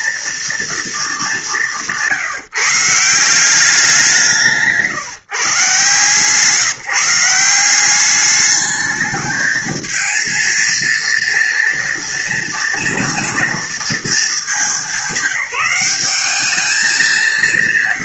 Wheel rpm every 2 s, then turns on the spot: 230, 160, 160, 150, 210, 230, 230, 220, 210.
none